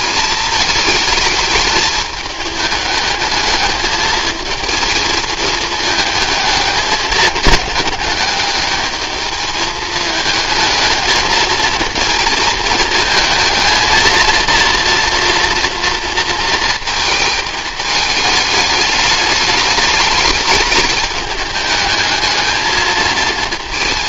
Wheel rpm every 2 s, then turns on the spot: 220, 210, 220, 210, 210, 220, 220, 240, 220, 210, 210, 220.
none